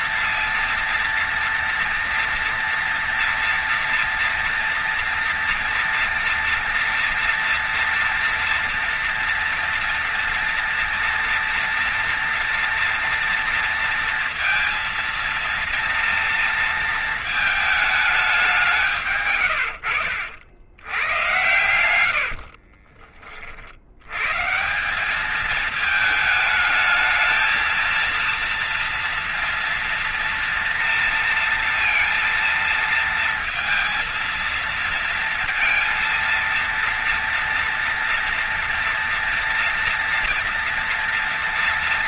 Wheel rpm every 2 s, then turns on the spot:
230, 230, 230, 240, 230, 230, 230, 230, 230, 180, 80, 70, 130, 220, 230, 230, 230, 230, 230, 230, 230.
22-24